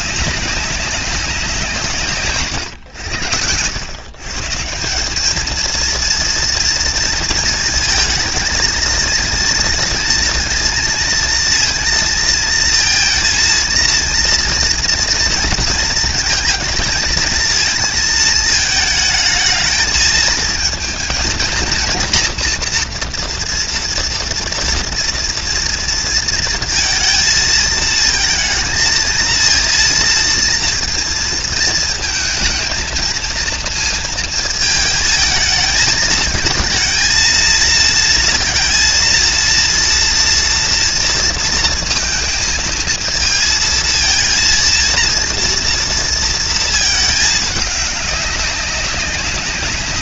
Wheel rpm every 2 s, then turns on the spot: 190, 130, 150, 230, 220, 230, 230, 230, 230, 220, 220, 230, 230, 230, 220, 230, 220, 220, 220, 230, 230, 230, 230, 230, 200.
none